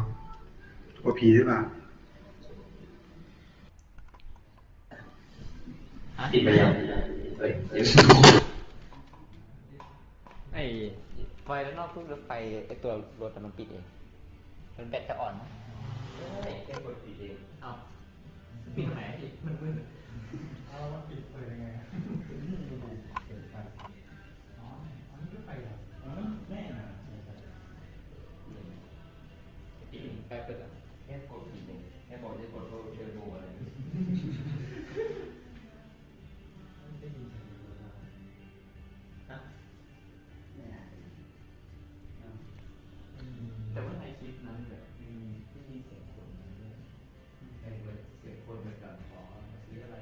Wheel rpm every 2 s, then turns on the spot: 0, 0, 0, 0, 0, 0, 0, 0, 0, 0, 0, 0, 0, 0, 0, 0, 0, 0, 0, 0, 0, 0, 0, 0, 0.
none